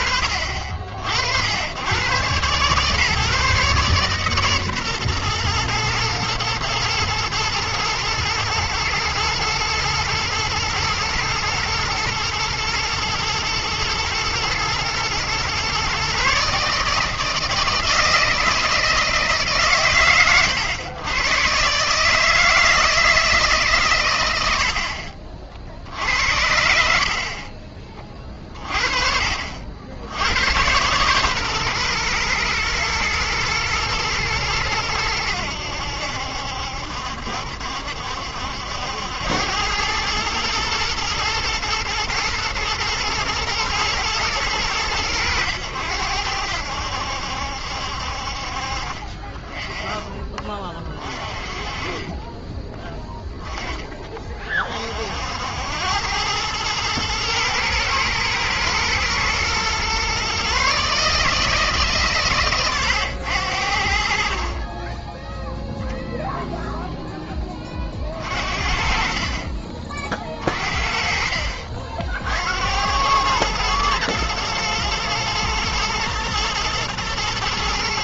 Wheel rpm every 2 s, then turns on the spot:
70, 140, 130, 110, 110, 110, 120, 120, 150, 160, 110, 160, 70, 80, 30, 100, 120, 110, 70, 70, 110, 110, 100, 80, 50, 20, 20, 30, 110, 120, 140, 120, 40, 0, 40, 40, 70, 110, 120.
52-54